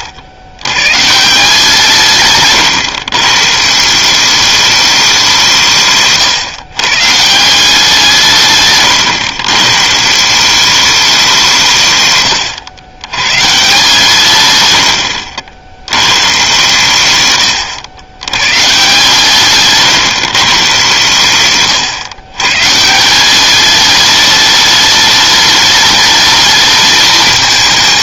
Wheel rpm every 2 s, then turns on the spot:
110, 120, 200, 130, 130, 200, 100, 110, 120, 130, 130, 150, 210, 210.
none